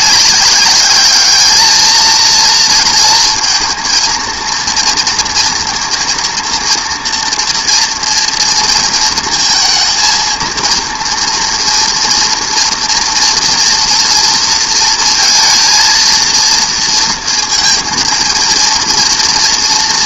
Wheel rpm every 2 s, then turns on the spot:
200, 230, 230, 230, 230, 230, 230, 230, 230, 230.
none